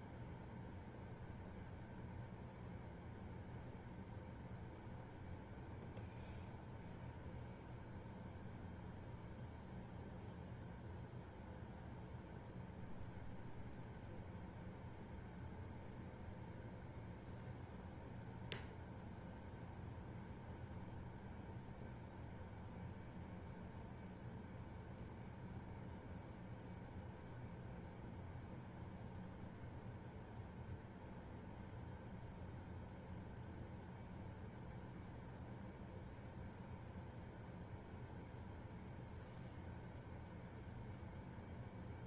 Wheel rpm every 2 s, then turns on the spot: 0, 0, 0, 0, 0, 0, 0, 0, 0, 0, 0, 0, 0, 0, 0, 0, 0, 0, 0, 0, 0.
none